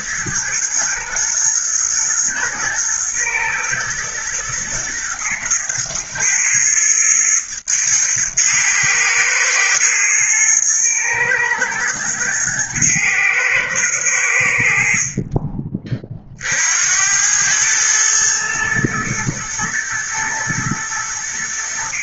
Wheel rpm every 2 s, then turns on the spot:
110, 120, 120, 110, 110, 110, 110, 50, 80, 110, 100.
none